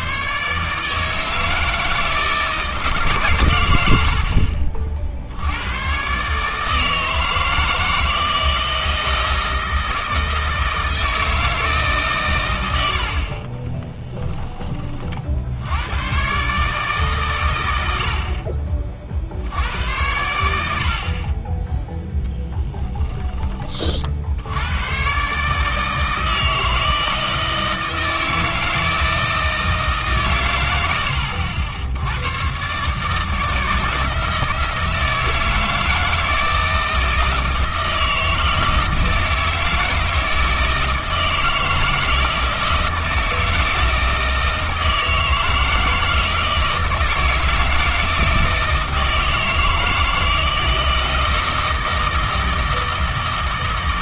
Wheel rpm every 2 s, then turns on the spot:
150, 160, 50, 160, 160, 160, 80, 30, 140, 40, 70, 10, 110, 160, 160, 90, 130, 160, 160, 160, 160, 160, 160, 160, 160, 160, 160.
none